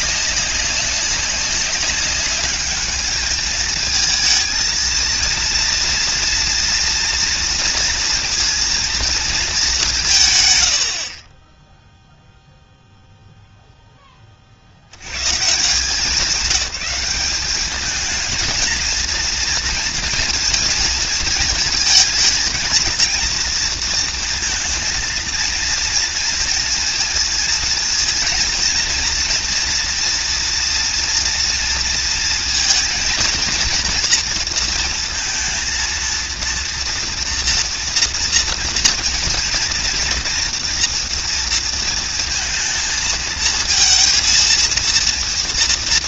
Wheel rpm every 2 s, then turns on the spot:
200, 210, 230, 240, 230, 60, 0, 110, 200, 230, 220, 220, 230, 230, 230, 230, 230, 230, 230, 230, 230, 220, 230.
none